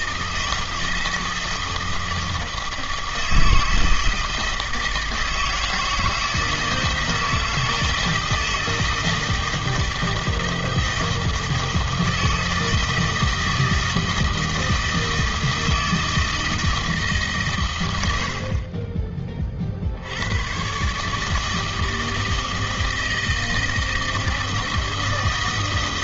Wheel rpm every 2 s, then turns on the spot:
160, 160, 160, 160, 160, 160, 160, 160, 160, 30, 120, 160, 160.
none